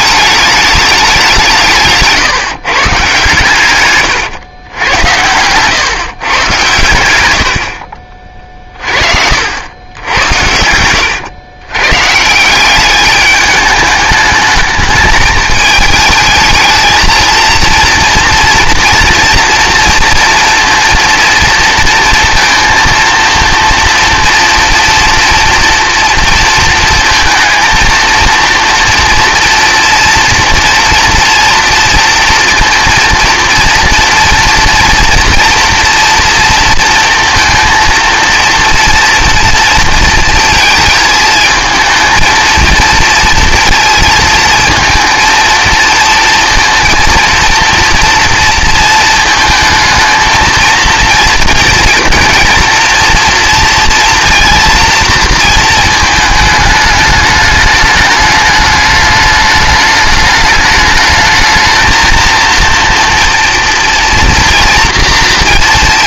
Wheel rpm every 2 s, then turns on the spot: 210, 140, 110, 120, 40, 90, 180, 210, 220, 230, 230, 230, 230, 230, 230, 230, 230, 230, 230, 230, 230, 230, 230, 230, 230, 230, 230, 230, 210, 210, 210, 230, 230.
10-12